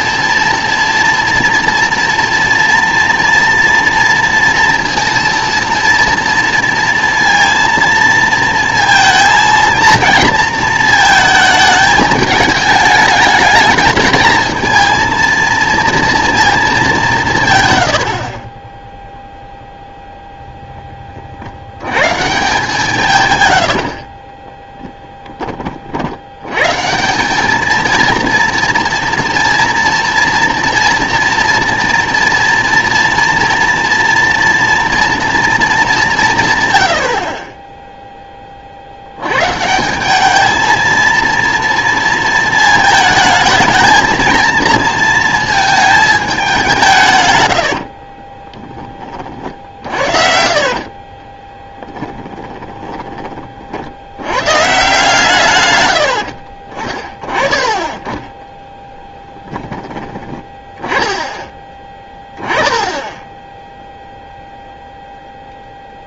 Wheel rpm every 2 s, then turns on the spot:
230, 230, 230, 230, 230, 230, 210, 220, 210, 20, 10, 160, 10, 140, 230, 240, 230, 230, 100, 50, 220, 220, 230, 180, 20, 40, 10, 140, 40, 10, 10, 10, 0.
50-54